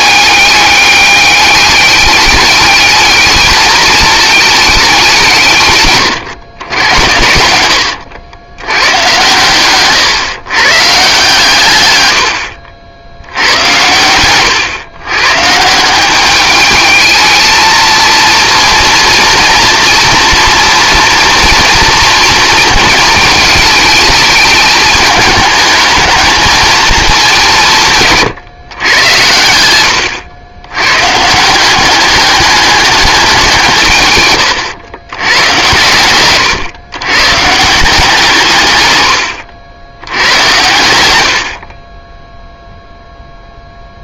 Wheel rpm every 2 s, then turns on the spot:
210, 210, 200, 100, 110, 140, 60, 120, 210, 230, 240, 230, 210, 210, 110, 100, 200, 100, 120, 130, 100, 0.
none